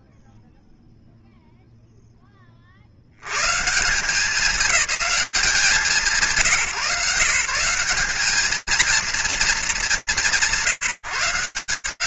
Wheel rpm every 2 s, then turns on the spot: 0, 40, 200, 150, 230, 160.
none